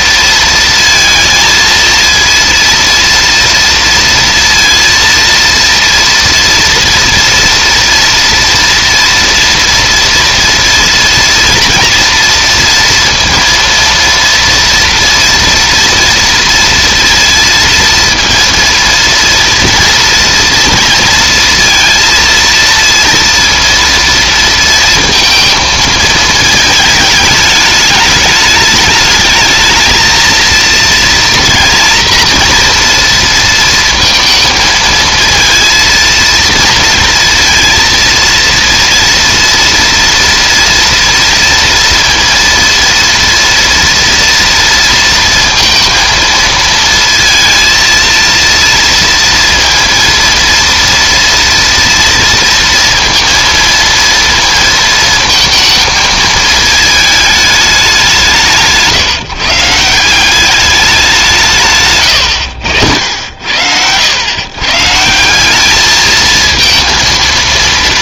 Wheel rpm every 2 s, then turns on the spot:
230, 230, 230, 230, 230, 230, 230, 230, 230, 230, 230, 230, 230, 220, 210, 230, 230, 230, 230, 230, 230, 230, 230, 230, 230, 230, 230, 230, 220, 150, 200, 90, 130, 230.
none